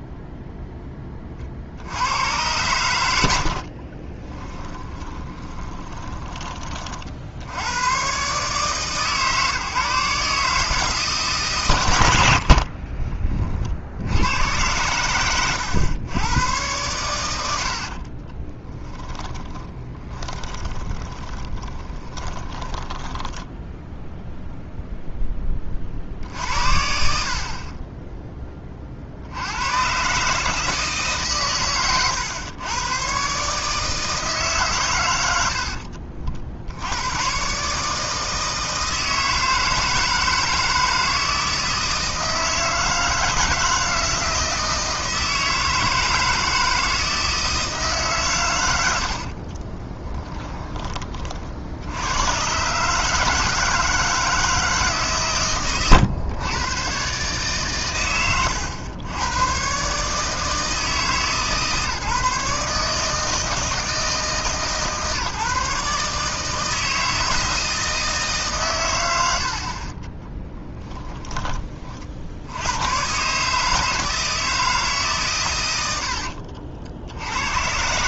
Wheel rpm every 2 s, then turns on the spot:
10, 100, 20, 30, 140, 160, 50, 100, 110, 10, 20, 10, 0, 40, 30, 150, 120, 130, 70, 160, 160, 160, 160, 160, 100, 20, 130, 160, 110, 100, 150, 150, 140, 160, 150, 10, 90, 160, 60.
4-6 12-14 18-24 70-72